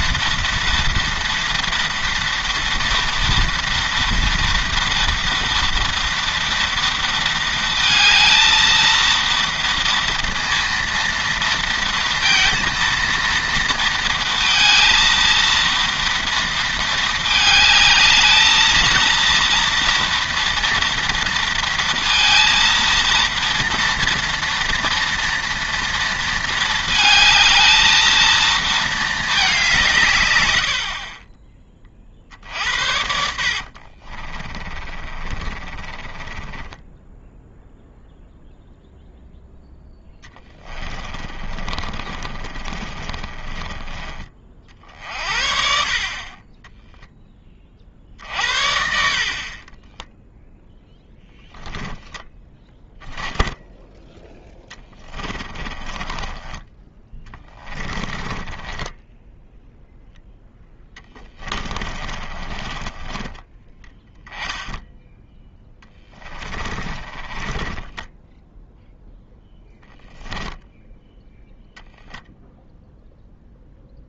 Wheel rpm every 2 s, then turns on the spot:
230, 230, 230, 230, 230, 230, 230, 230, 230, 220, 230, 230, 230, 220, 230, 80, 60, 30, 20, 0, 20, 40, 40, 10, 50, 0, 10, 10, 20, 20, 10, 20, 10, 20, 0, 0, 0.
34-38 40-44 54-56 58-64 66-68